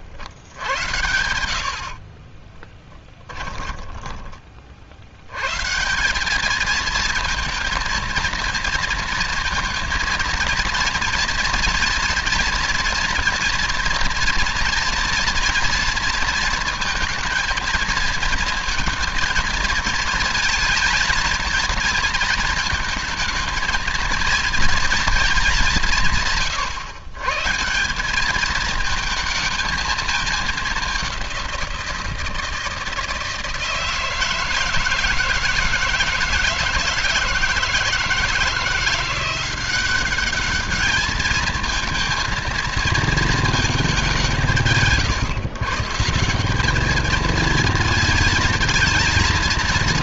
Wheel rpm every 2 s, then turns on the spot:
80, 10, 70, 220, 230, 230, 230, 230, 230, 220, 230, 220, 220, 140, 220, 200, 160, 170, 160, 170, 210, 230, 150, 210, 230.
2-4